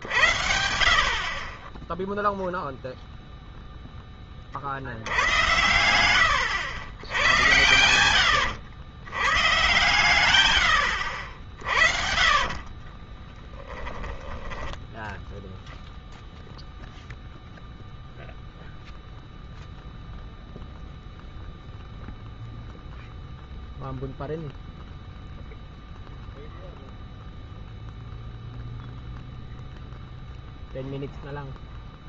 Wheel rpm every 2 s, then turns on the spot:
70, 0, 50, 90, 100, 110, 40, 10, 0, 0, 0, 0, 0, 0, 0, 0.
12-16